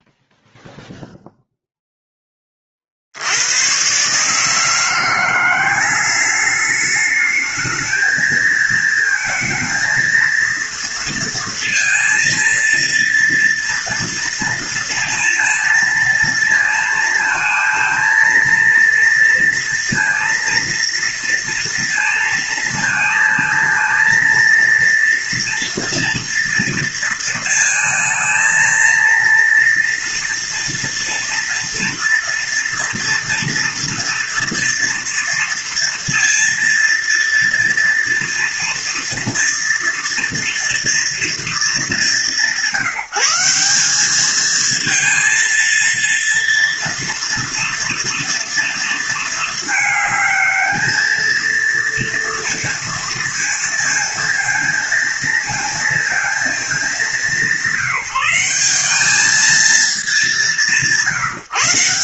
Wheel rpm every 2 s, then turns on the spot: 0, 80, 170, 210, 230, 230, 230, 230, 230, 230, 230, 230, 230, 230, 230, 240, 230, 230, 230, 230, 220, 180, 230, 230, 230, 220, 230, 220, 180, 210, 160.
none